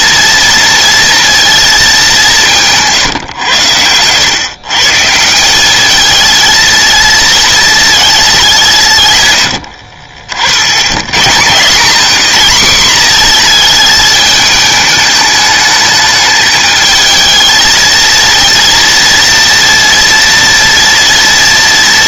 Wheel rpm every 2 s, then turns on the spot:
230, 160, 140, 230, 180, 70, 210, 210, 220, 230, 230.
none